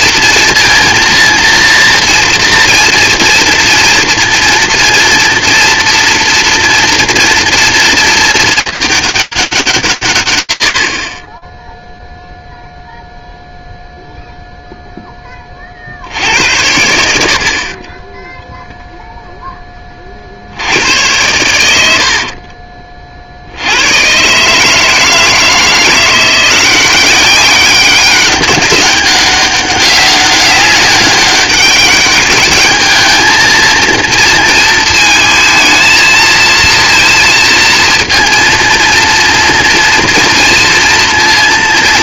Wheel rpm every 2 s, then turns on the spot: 230, 230, 230, 230, 220, 120, 0, 0, 80, 0, 80, 40, 150, 190, 200, 200, 210, 220, 230, 230, 230.
none